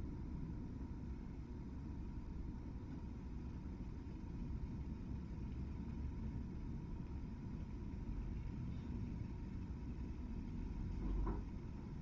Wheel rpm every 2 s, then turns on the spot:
0, 0, 0, 0, 0, 0.
none